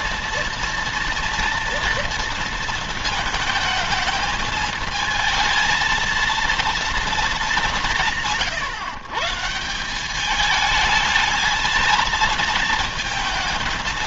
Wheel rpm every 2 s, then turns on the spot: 230, 230, 220, 230, 130, 220, 230.
none